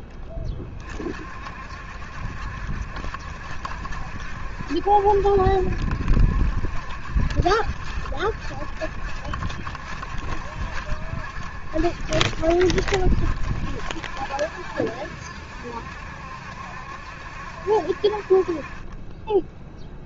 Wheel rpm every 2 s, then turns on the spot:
40, 70, 70, 70, 70, 70, 60, 70, 70, 40.
none